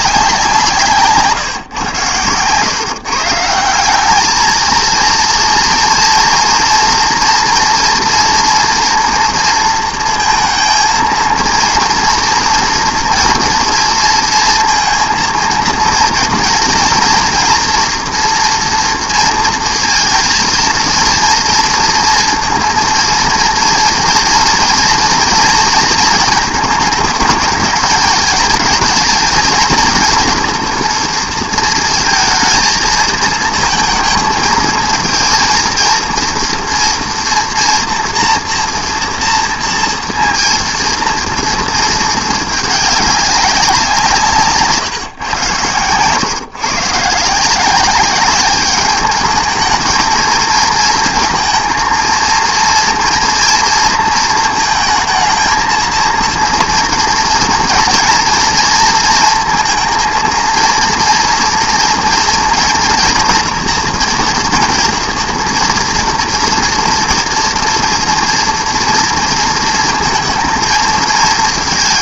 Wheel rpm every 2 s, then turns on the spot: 160, 130, 230, 230, 230, 230, 230, 230, 230, 230, 230, 230, 230, 220, 210, 230, 230, 230, 240, 230, 230, 210, 150, 130, 200, 230, 230, 220, 230, 230, 230, 230, 240, 240, 230, 230.
none